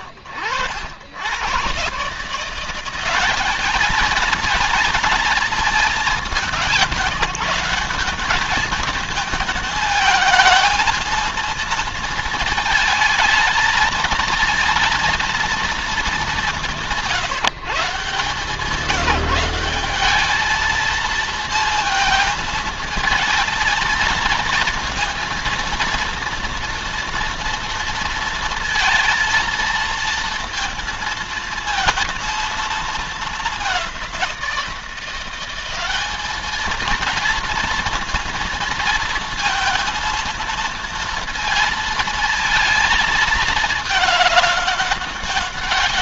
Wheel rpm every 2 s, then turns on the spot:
70, 180, 220, 170, 220, 230, 220, 230, 170, 170, 230, 220, 230, 230, 230, 230, 220, 180, 220, 230, 230, 220, 200.
none